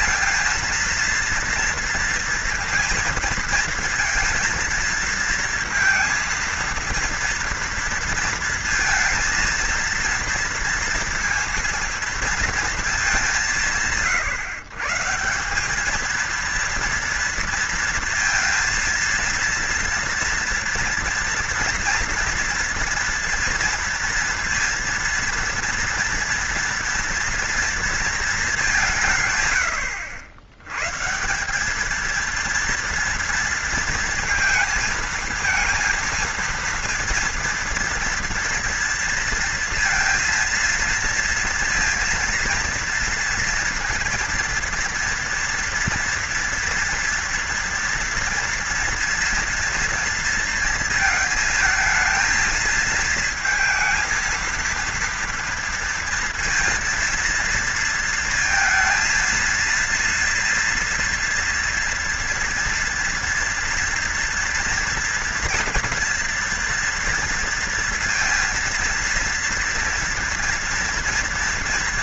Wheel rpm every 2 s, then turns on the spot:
230, 230, 230, 230, 230, 230, 220, 150, 230, 230, 240, 230, 230, 230, 190, 110, 230, 230, 230, 230, 230, 230, 230, 230, 230, 230, 230, 230, 230, 230, 230, 230, 240, 240, 230, 230.
none